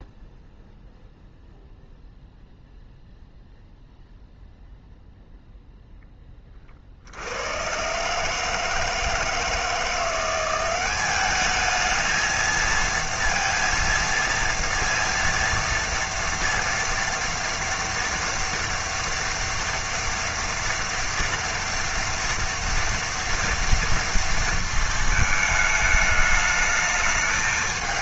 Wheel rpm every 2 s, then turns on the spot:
0, 0, 0, 20, 150, 180, 220, 230, 230, 230, 230, 230, 230, 210.
none